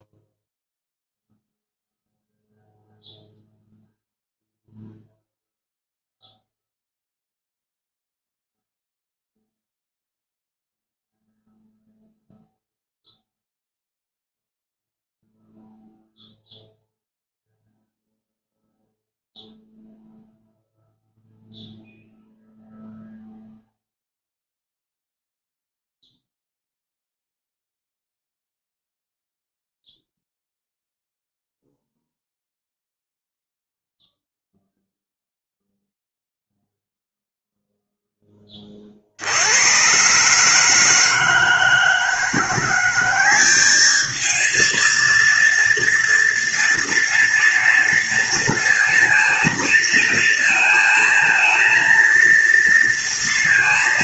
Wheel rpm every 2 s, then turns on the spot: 0, 0, 0, 0, 0, 0, 0, 0, 0, 0, 0, 0, 0, 0, 0, 0, 0, 0, 0, 60, 160, 190, 230, 230, 230, 220, 230.
none